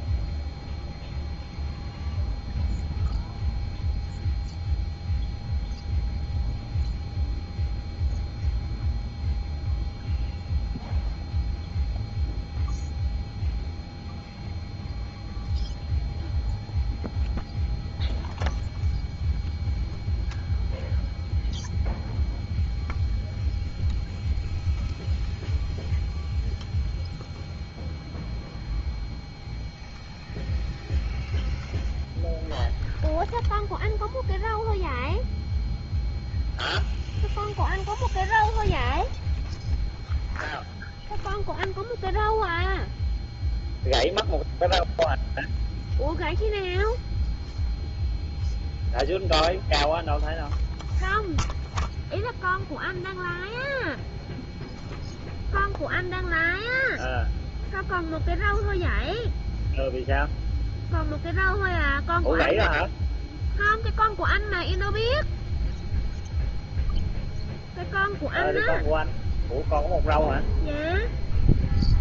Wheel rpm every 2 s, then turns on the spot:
0, 0, 0, 0, 0, 0, 0, 0, 0, 0, 0, 0, 0, 0, 0, 0, 0, 0, 0, 0, 0, 0, 0, 0, 0, 0, 0, 0, 0, 0, 0, 0, 0, 0, 0, 0.
none